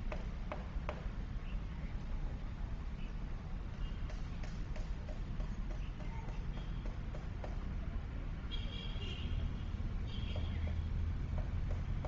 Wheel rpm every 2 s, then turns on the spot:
0, 0, 0, 0, 0, 0.
none